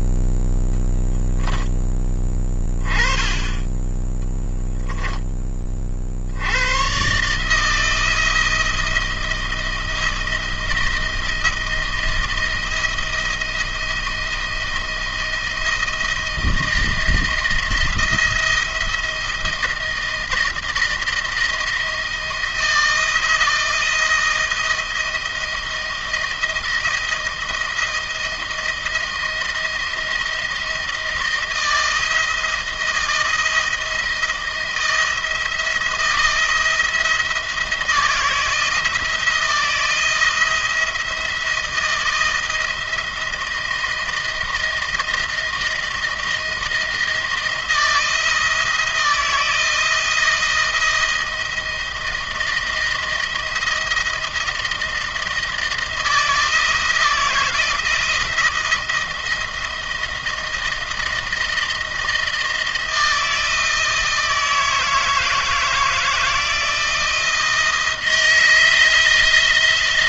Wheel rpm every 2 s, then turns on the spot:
0, 20, 10, 90, 160, 160, 160, 170, 170, 170, 160, 170, 170, 160, 170, 170, 160, 160, 170, 160, 170, 170, 170, 160, 160, 160, 170, 170, 170, 160, 160, 160, 160, 170, 160.
none